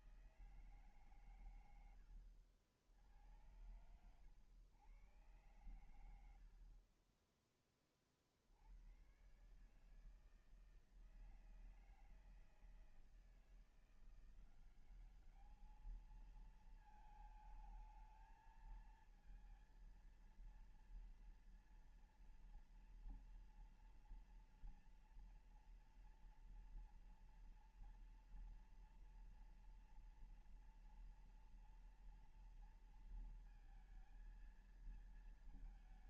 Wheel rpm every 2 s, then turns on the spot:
160, 80, 100, 80, 50, 160, 160, 180, 220, 220, 230, 230, 230, 230, 230, 230, 230, 220.
none